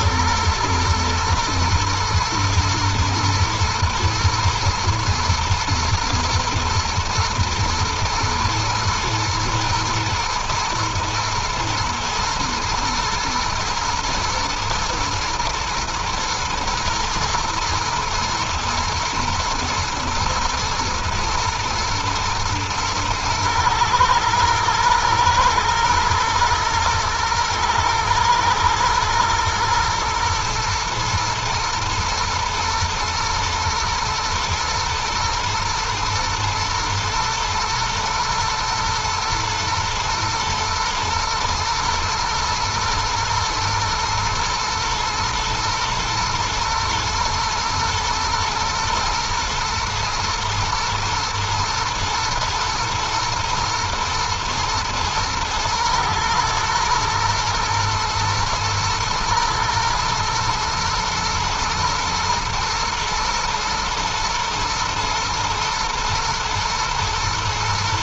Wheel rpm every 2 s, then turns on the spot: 110, 110, 110, 110, 120, 110, 110, 120, 110, 120, 110, 110, 110, 120, 110, 120, 120, 120, 110, 110, 110, 110, 110, 110, 120, 120, 120, 110, 110, 110, 110, 110, 120, 120.
none